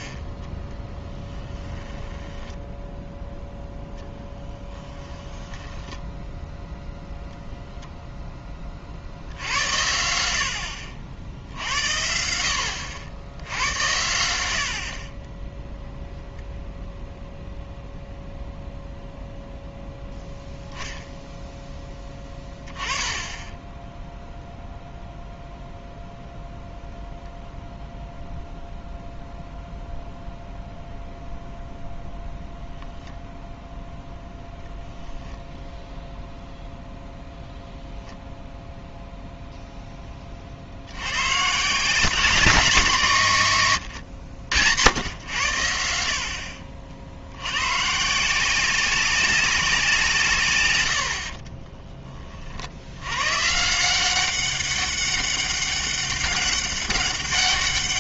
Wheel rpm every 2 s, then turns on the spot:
20, 10, 10, 0, 20, 70, 70, 60, 0, 0, 0, 10, 0, 0, 0, 0, 0, 0, 0, 0, 60, 190, 100, 60, 190, 120, 60, 200, 200.
2-6